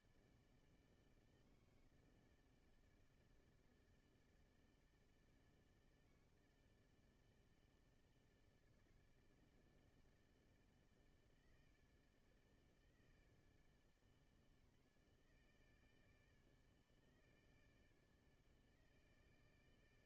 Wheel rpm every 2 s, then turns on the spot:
140, 160, 160, 160, 160, 160, 160, 140, 150, 150.
none